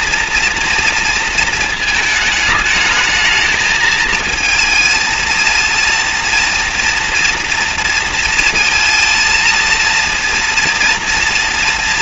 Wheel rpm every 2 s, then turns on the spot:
240, 220, 230, 230, 230, 230.
none